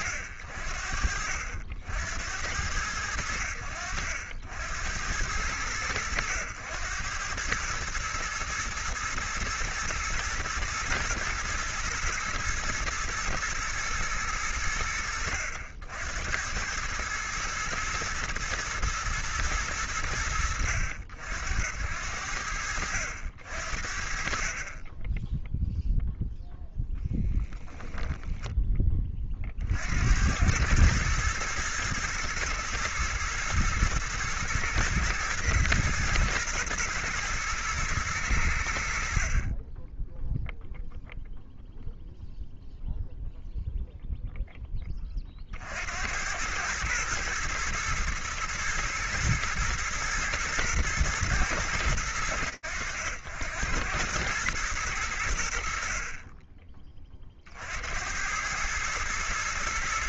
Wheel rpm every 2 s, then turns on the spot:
70, 60, 90, 110, 110, 120, 110, 70, 110, 110, 80, 60, 0, 10, 40, 110, 120, 110, 110, 50, 0, 0, 20, 110, 120, 110, 100, 100, 30, 100.
none